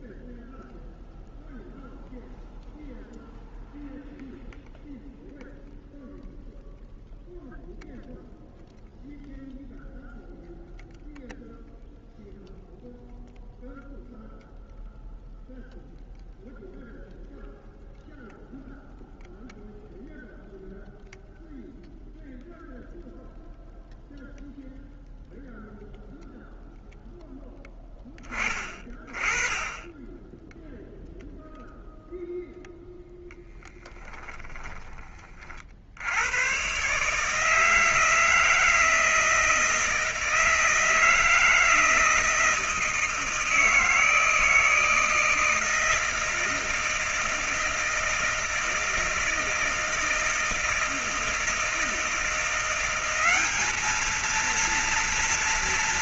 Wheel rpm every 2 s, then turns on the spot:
0, 0, 0, 0, 0, 0, 0, 0, 0, 0, 0, 0, 0, 0, 10, 10, 0, 10, 90, 160, 160, 160, 160, 160, 160, 160, 170, 220.
none